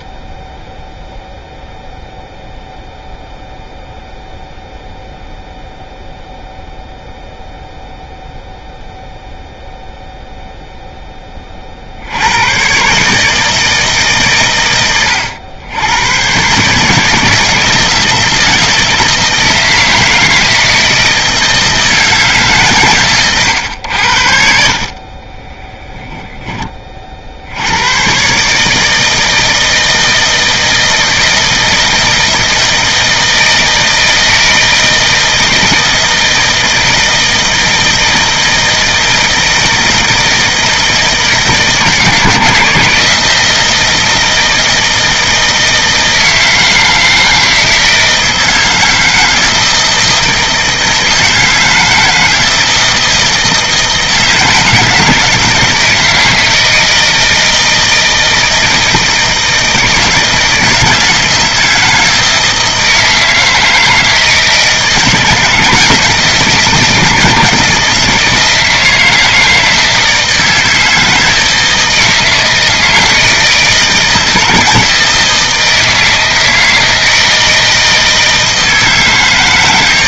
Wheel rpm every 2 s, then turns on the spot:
0, 0, 0, 0, 0, 0, 120, 110, 140, 160, 160, 130, 50, 20, 150, 160, 160, 160, 160, 160, 160, 160, 160, 160, 160, 160, 160, 160, 160, 160, 160, 160, 160, 160, 160, 160, 160, 160, 160, 160.
none